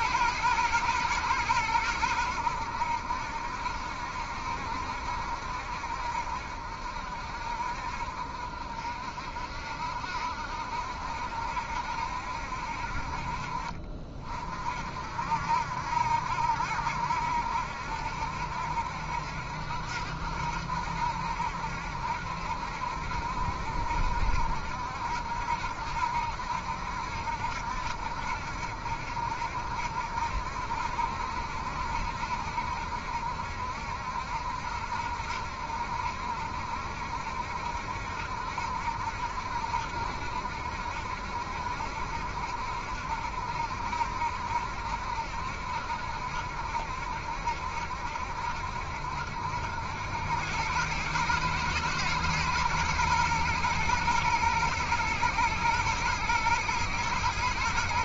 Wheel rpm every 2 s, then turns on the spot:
120, 90, 70, 60, 50, 60, 60, 50, 70, 70, 70, 70, 70, 70, 70, 70, 70, 70, 70, 70, 70, 70, 70, 70, 70, 100, 120, 110, 120.
none